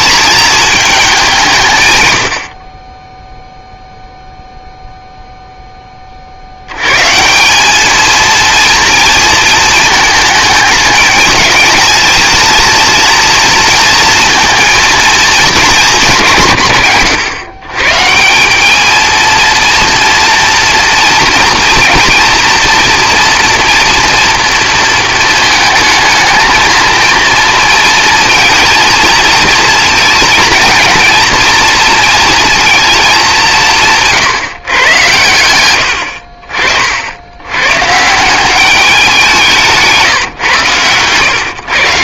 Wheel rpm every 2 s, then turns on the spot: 220, 40, 0, 80, 230, 210, 230, 230, 150, 210, 230, 230, 230, 220, 230, 220, 230, 140, 50, 190, 120.
none